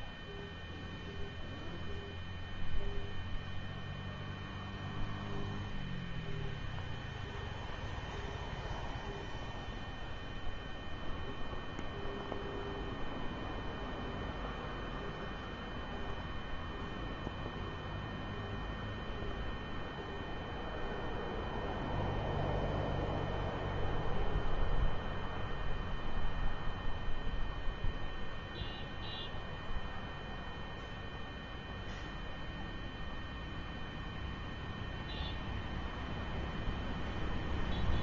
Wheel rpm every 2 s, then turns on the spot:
0, 0, 0, 0, 0, 0, 0, 0, 0, 0, 0, 0, 0, 0, 0, 0, 0, 0, 0.
none